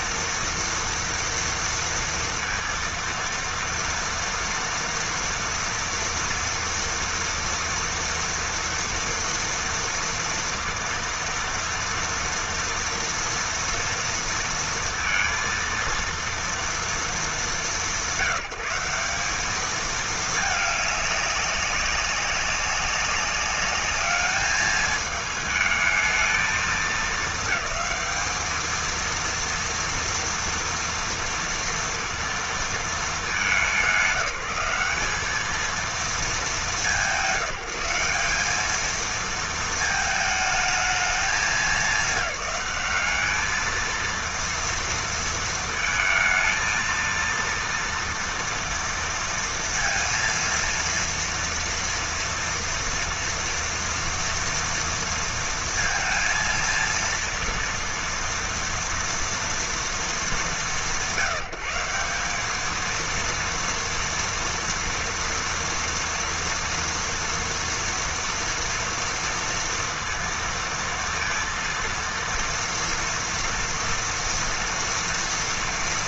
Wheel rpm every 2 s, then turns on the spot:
230, 230, 230, 230, 230, 230, 230, 230, 220, 190, 200, 200, 220, 220, 230, 230, 210, 200, 190, 220, 200, 200, 230, 230, 230, 230, 230, 230, 230, 230, 170, 220, 230, 230, 230, 230, 230, 230.
none